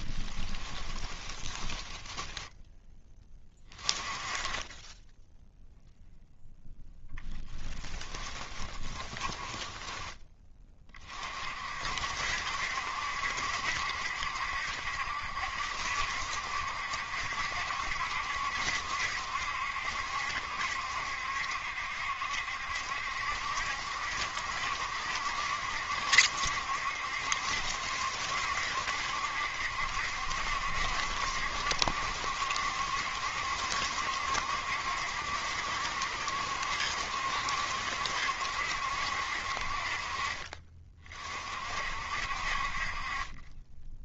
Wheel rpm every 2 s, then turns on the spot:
10, 10, 20, 0, 10, 20, 70, 70, 70, 70, 70, 70, 70, 70, 70, 70, 70, 70, 70, 70, 40, 50.
0-2 8-10